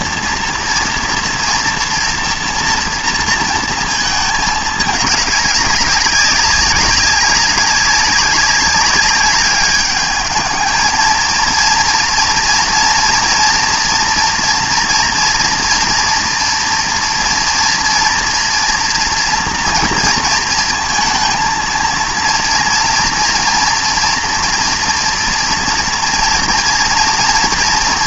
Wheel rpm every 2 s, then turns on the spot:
240, 230, 210, 190, 200, 220, 230, 230, 230, 230, 230, 230, 230, 230.
none